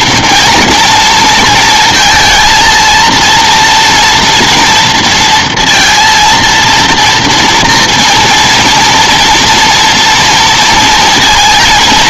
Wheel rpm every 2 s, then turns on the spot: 240, 230, 230, 230, 230, 230.
none